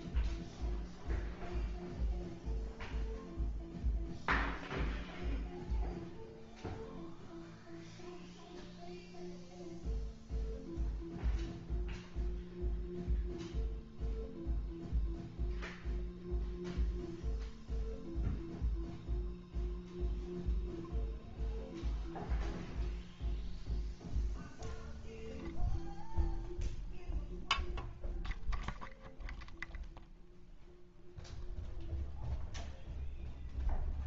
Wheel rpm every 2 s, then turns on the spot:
0, 0, 0, 0, 0, 0, 0, 0, 0, 0, 0, 0, 0, 0, 0, 0, 0.
none